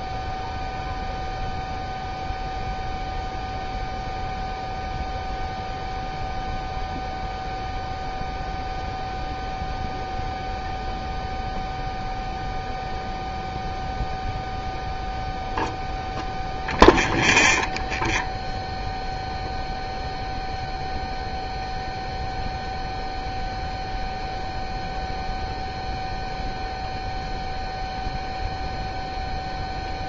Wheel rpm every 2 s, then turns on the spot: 0, 0, 0, 0, 0, 0, 0, 0, 0, 0, 0, 0, 0, 0, 0.
none